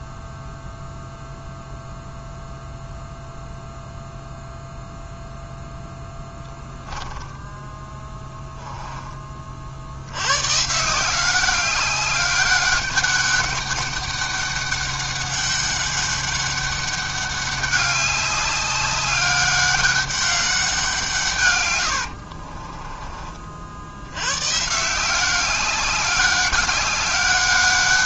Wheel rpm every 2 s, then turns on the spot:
0, 0, 0, 10, 10, 150, 200, 200, 200, 200, 180, 20, 150, 200.
6-8 22-24